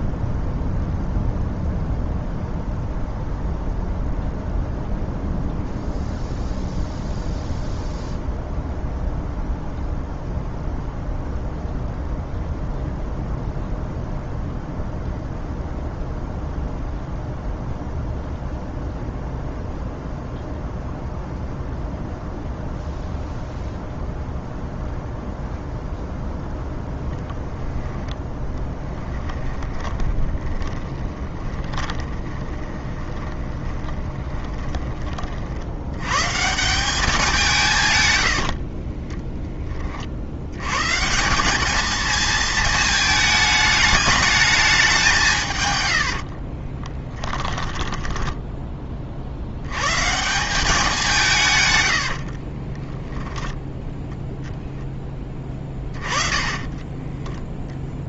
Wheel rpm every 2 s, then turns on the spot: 0, 0, 0, 0, 0, 0, 0, 0, 0, 0, 0, 0, 0, 10, 10, 20, 20, 20, 190, 40, 120, 220, 200, 30, 20, 190, 20, 10, 20.
28-34 38-40 46-48 52-54 56-58